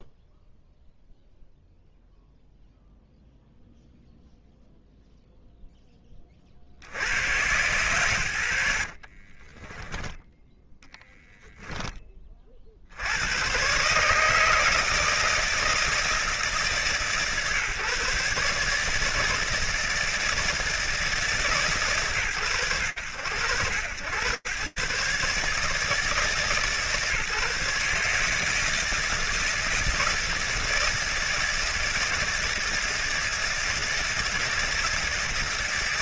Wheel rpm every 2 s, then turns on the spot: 0, 0, 0, 20, 100, 10, 30, 160, 150, 150, 160, 100, 120, 150, 150, 160, 160, 160.
10-12